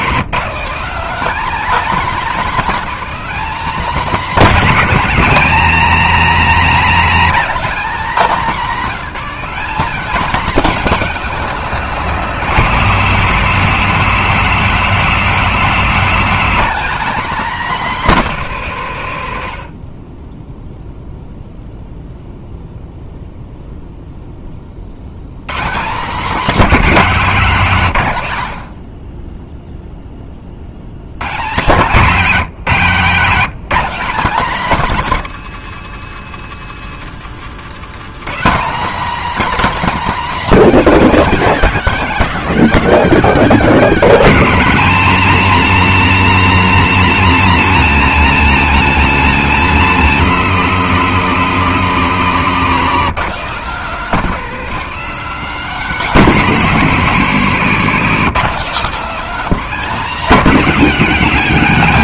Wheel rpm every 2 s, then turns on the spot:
220, 250, 250, 240, 240, 250, 230, 230, 250, 190, 0, 0, 40, 230, 90, 90, 190, 230, 150, 240, 260, 250, 250, 260, 230, 220, 210, 230, 210, 220, 230.
8-10